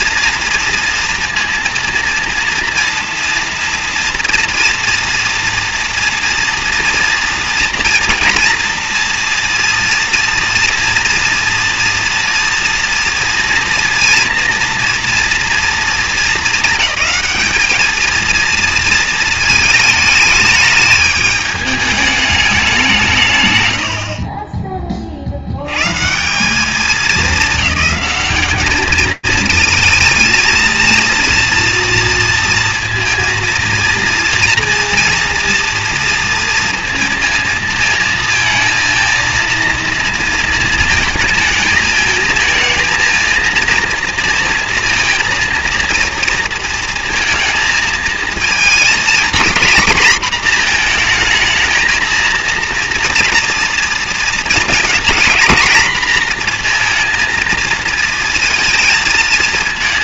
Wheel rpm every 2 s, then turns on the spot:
230, 230, 230, 230, 230, 230, 230, 230, 220, 230, 210, 200, 30, 190, 200, 220, 230, 230, 230, 230, 230, 220, 230, 230, 230, 230, 230, 230, 230, 220.
none